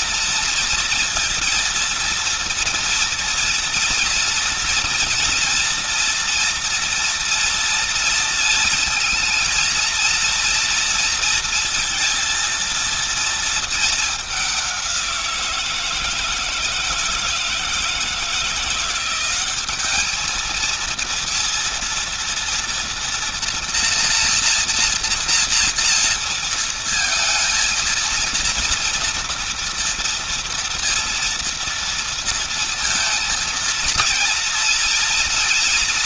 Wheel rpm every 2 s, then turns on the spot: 230, 230, 230, 230, 230, 230, 230, 200, 160, 170, 220, 230, 240, 230, 230, 230, 230, 230.
none